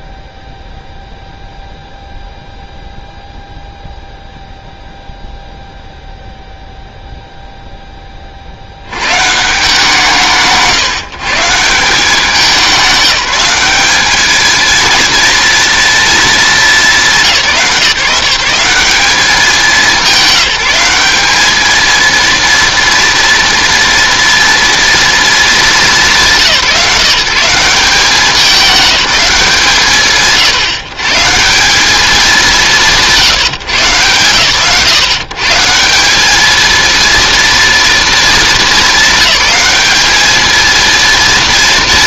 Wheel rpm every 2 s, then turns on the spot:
0, 0, 0, 0, 70, 150, 190, 230, 220, 180, 190, 230, 230, 160, 210, 160, 180, 140, 230, 230, 230.
none